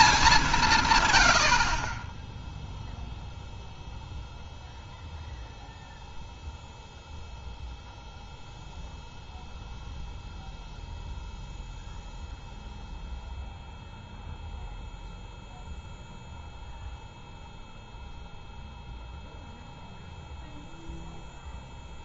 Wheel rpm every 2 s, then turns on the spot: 170, 0, 0, 0, 0, 0, 0, 0, 0, 0, 0.
none